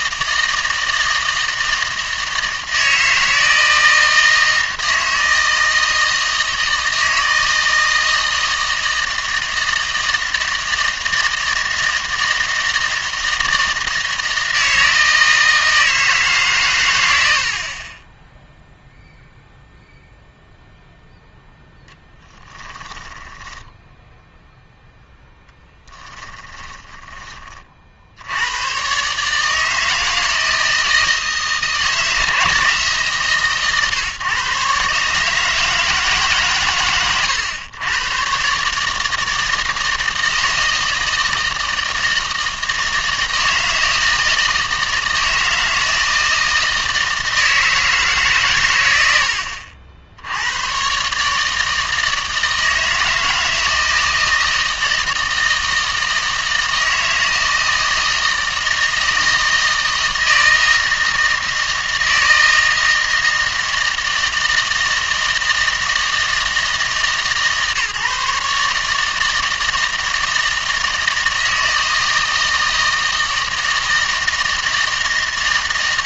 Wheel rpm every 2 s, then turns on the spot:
160, 160, 160, 160, 160, 160, 160, 160, 120, 0, 0, 10, 0, 10, 120, 160, 160, 130, 130, 150, 160, 160, 160, 160, 130, 110, 160, 160, 160, 160, 160, 160, 160, 160, 150, 160, 160, 160.
22-24 26-28